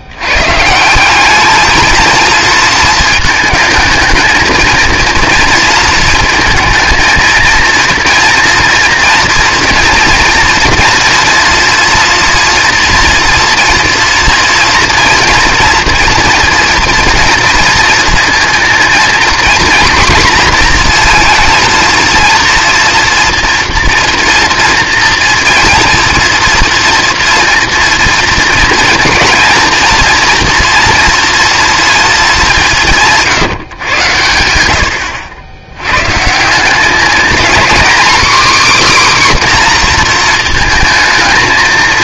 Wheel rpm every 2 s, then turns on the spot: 150, 220, 220, 220, 230, 240, 240, 230, 230, 230, 250, 230, 230, 240, 230, 230, 200, 90, 180, 280, 220.
none